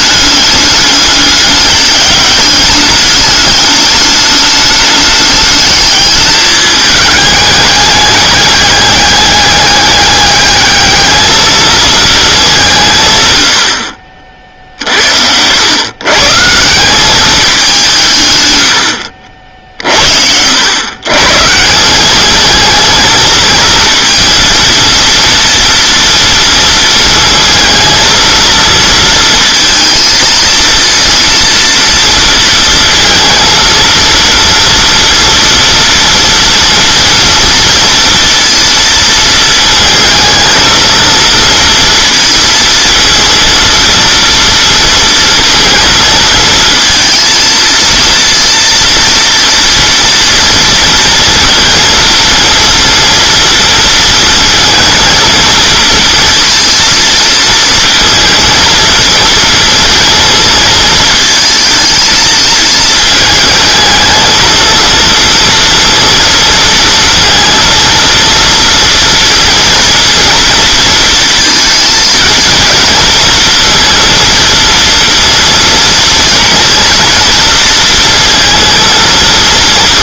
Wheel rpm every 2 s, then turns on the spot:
210, 210, 210, 210, 200, 210, 180, 50, 170, 110, 80, 220, 230, 230, 230, 230, 230, 230, 230, 230, 230, 230, 230, 220, 230, 230, 230, 230, 230, 230, 220, 220, 230, 230, 230, 230, 230, 230, 230, 230.
none